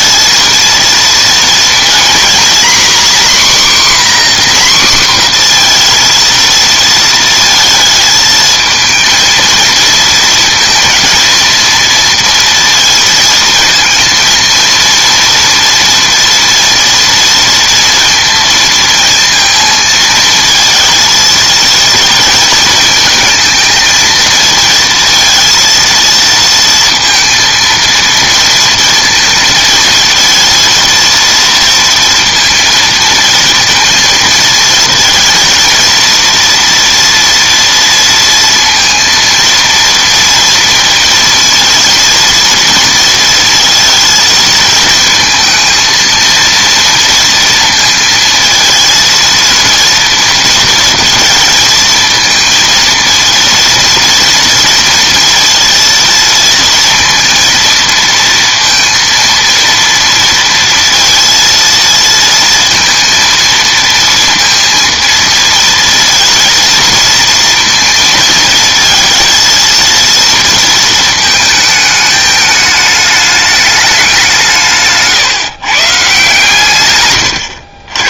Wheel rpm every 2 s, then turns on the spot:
230, 260, 250, 230, 230, 230, 230, 230, 230, 230, 220, 220, 230, 230, 230, 230, 230, 230, 230, 230, 230, 230, 220, 230, 230, 220, 230, 230, 230, 230, 230, 230, 230, 230, 230, 220, 210, 140, 120.
76-78